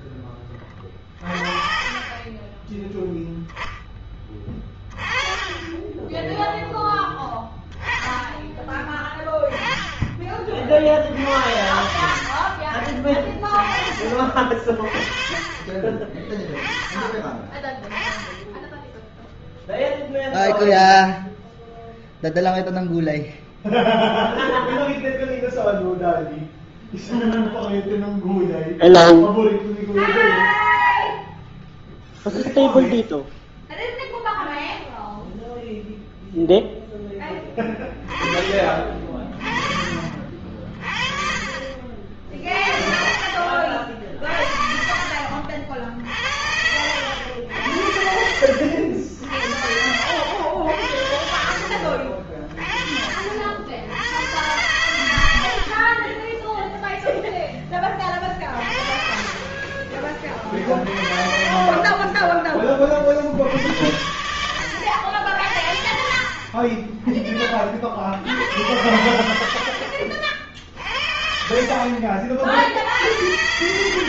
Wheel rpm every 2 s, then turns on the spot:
20, 30, 10, 10, 20, 30, 50, 40, 20, 20, 0, 0, 0, 0, 0, 0, 0, 0, 0, 10, 30, 50, 50, 50, 70, 70, 50, 80, 50, 10, 30, 30, 60, 60, 30, 80, 60.
none